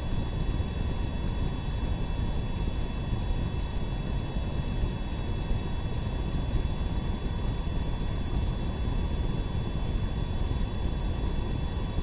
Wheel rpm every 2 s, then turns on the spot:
0, 0, 0, 0, 0, 0.
none